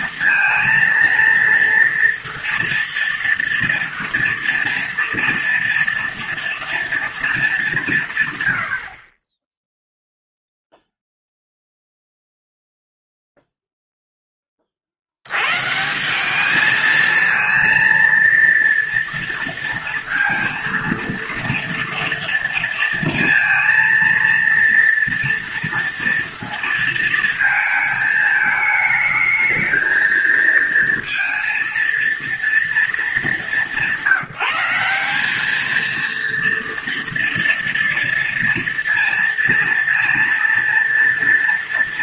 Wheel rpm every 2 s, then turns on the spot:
230, 230, 230, 230, 50, 0, 0, 40, 210, 230, 230, 230, 230, 220, 220, 230, 230, 190, 230, 230, 230.
none